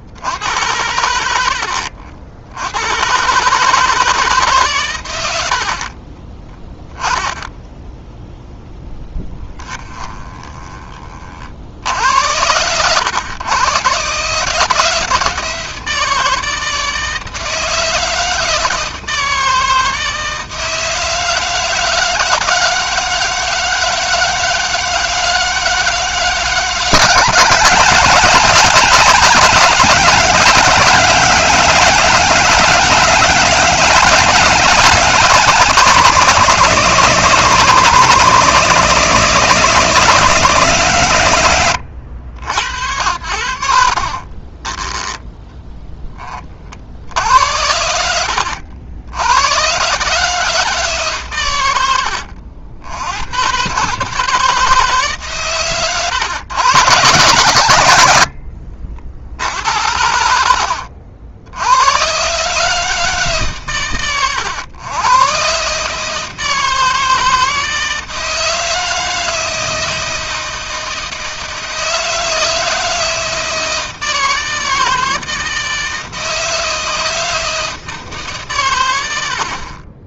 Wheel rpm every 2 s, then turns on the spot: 90, 90, 130, 10, 10, 20, 90, 160, 160, 160, 160, 160, 160, 160, 160, 160, 160, 160, 160, 160, 150, 80, 20, 50, 70, 150, 80, 160, 120, 60, 70, 150, 110, 160, 160, 160, 160, 160, 160, 110.
6-8 10-12 44-46 60-62